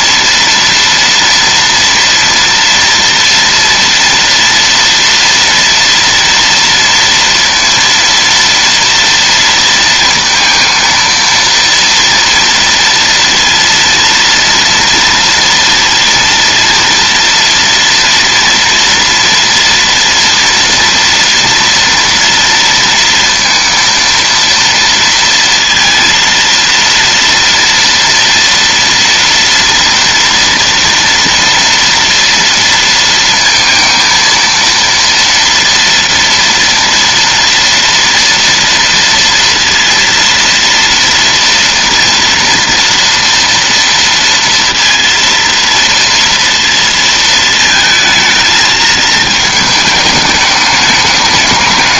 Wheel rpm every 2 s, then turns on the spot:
230, 230, 230, 230, 230, 230, 230, 230, 230, 230, 230, 230, 230, 230, 230, 230, 230, 230, 230, 240, 230, 240, 230, 230, 220, 210.
none